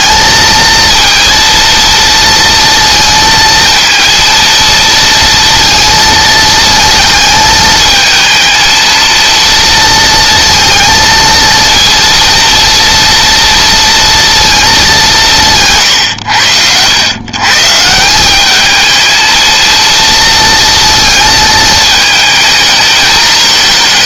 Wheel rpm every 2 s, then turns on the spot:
230, 230, 230, 220, 230, 230, 230, 190, 110, 220, 230, 220.
none